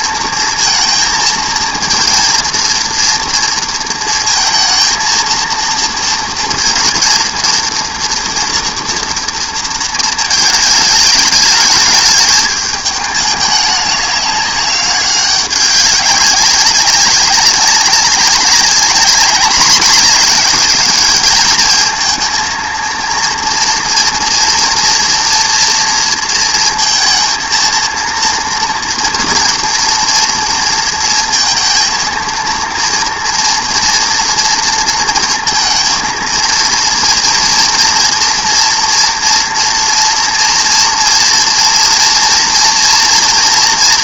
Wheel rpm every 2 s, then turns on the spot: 230, 230, 230, 230, 230, 220, 210, 200, 200, 200, 220, 230, 230, 230, 230, 230, 230, 230, 230, 230, 230, 230.
none